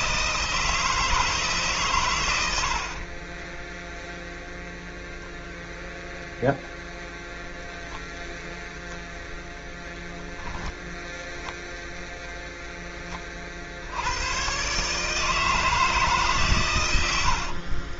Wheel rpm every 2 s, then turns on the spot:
160, 30, 0, 0, 0, 0, 20, 140, 110.
none